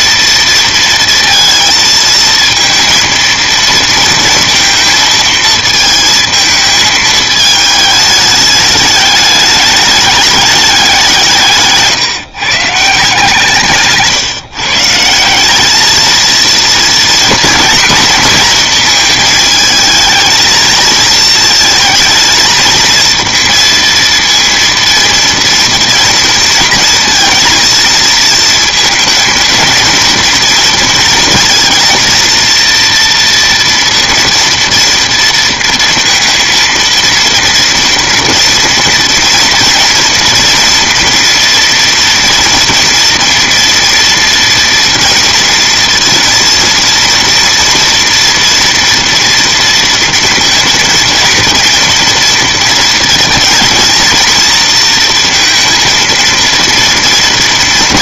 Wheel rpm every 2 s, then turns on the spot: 230, 230, 230, 220, 210, 180, 160, 170, 240, 230, 230, 230, 230, 230, 220, 240, 240, 230, 230, 230, 230, 230, 230, 230, 240, 230, 230, 230, 230.
none